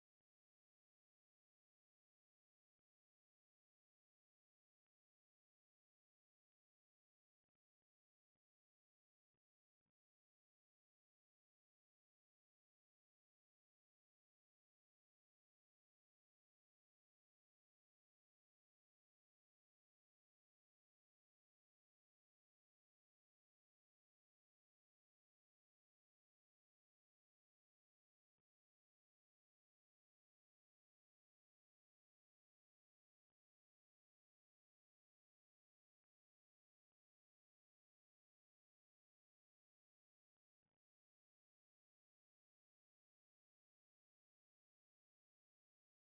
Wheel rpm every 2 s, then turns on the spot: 0, 0, 0, 0, 0, 0, 0, 0, 0, 0, 0, 0, 0, 0, 0, 0, 0, 0, 0, 0, 0, 0, 0.
none